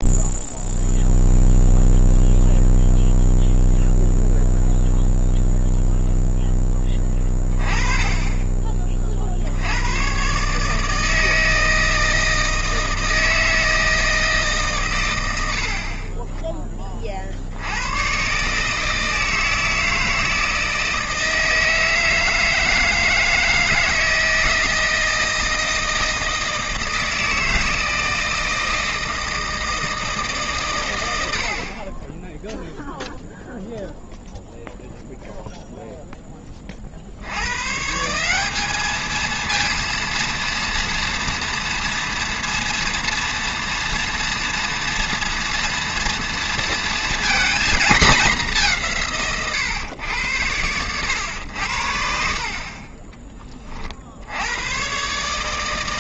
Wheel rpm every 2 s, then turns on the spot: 0, 0, 0, 20, 30, 160, 160, 130, 20, 160, 160, 160, 160, 160, 160, 110, 0, 0, 40, 210, 230, 230, 230, 230, 170, 100, 40, 110.
none